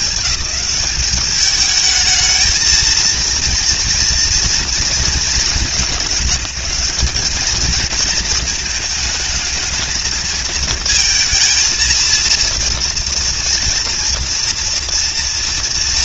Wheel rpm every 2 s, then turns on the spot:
180, 230, 230, 180, 220, 230, 230, 230.
none